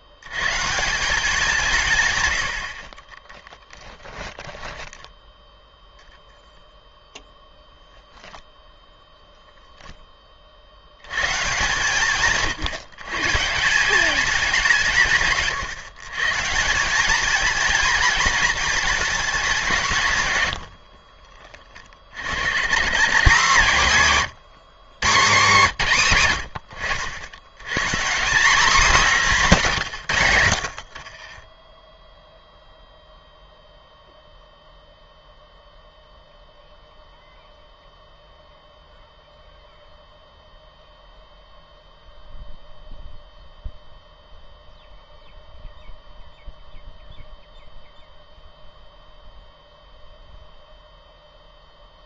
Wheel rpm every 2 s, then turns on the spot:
130, 60, 10, 0, 10, 50, 140, 180, 160, 230, 80, 120, 160, 110, 210, 90, 0, 0, 0, 0, 0, 0, 0, 0, 0, 0.
4-6 20-22